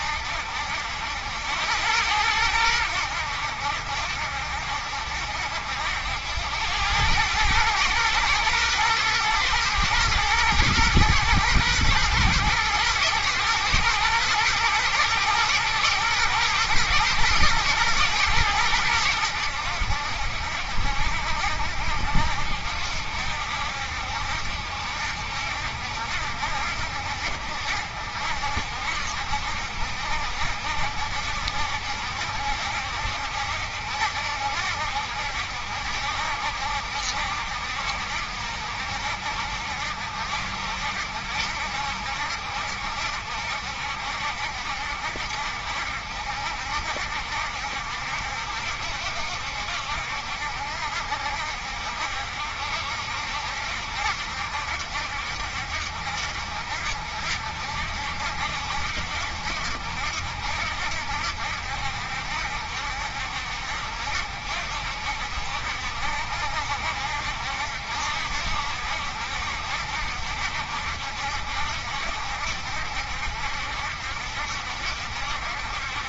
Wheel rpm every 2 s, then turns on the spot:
90, 80, 70, 100, 120, 110, 120, 110, 120, 90, 70, 70, 70, 70, 70, 70, 70, 70, 70, 70, 70, 70, 70, 70, 60, 60, 70, 70, 60, 70, 70, 60, 60, 70, 70, 70, 70, 70.
none